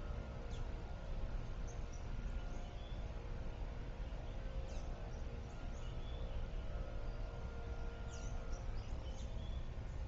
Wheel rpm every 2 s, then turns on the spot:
0, 0, 0, 0, 0.
none